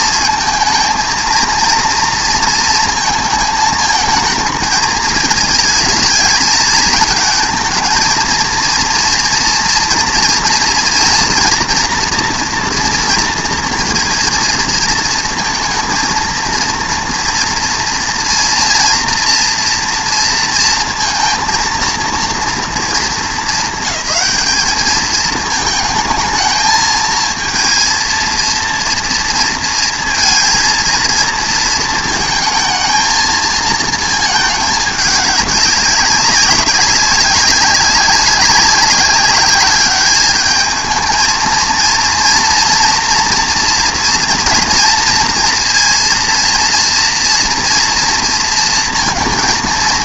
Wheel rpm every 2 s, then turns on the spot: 230, 220, 220, 220, 230, 230, 230, 230, 230, 240, 230, 230, 210, 220, 230, 230, 220, 210, 200, 190, 220, 230, 230, 230, 230.
none